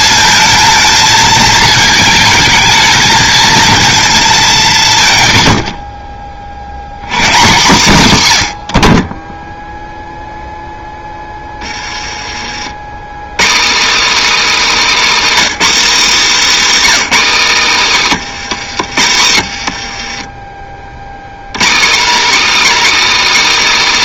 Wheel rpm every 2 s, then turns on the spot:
220, 220, 180, 70, 90, 0, 90, 300, 280, 160, 30, 290.
18-20